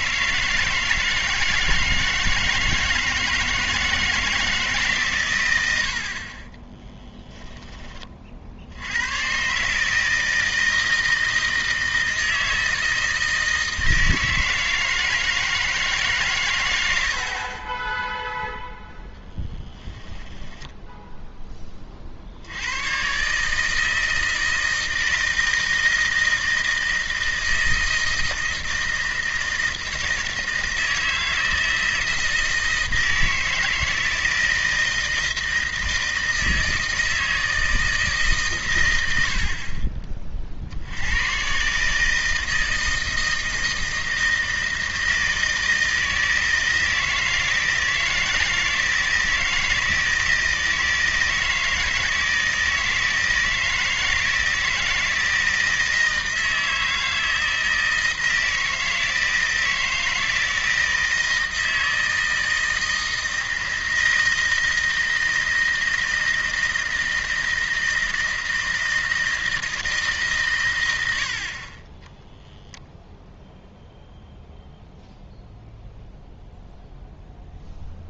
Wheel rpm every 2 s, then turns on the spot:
160, 160, 150, 10, 70, 160, 160, 160, 110, 0, 10, 90, 160, 160, 160, 160, 160, 160, 160, 120, 60, 160, 160, 160, 160, 160, 160, 160, 160, 160, 160, 160, 160, 160, 160, 110, 0, 0, 0.
20-22